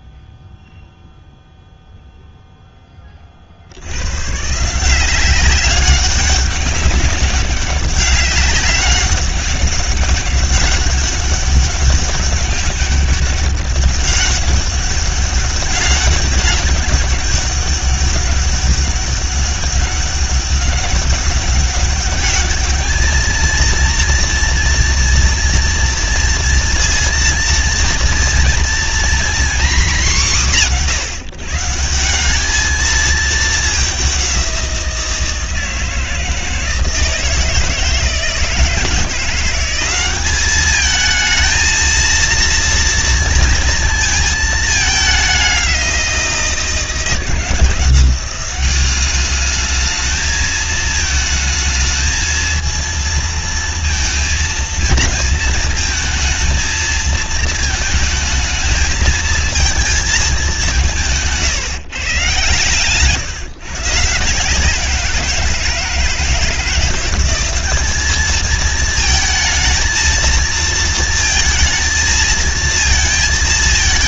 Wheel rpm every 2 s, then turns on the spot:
0, 30, 180, 200, 200, 200, 200, 200, 200, 200, 200, 220, 230, 230, 240, 160, 220, 170, 160, 170, 220, 230, 200, 160, 200, 220, 230, 230, 230, 220, 160, 150, 170, 180, 220, 230, 220.
none